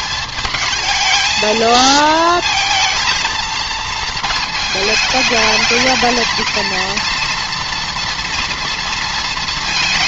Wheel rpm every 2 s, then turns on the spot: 220, 230, 220, 230, 230.
none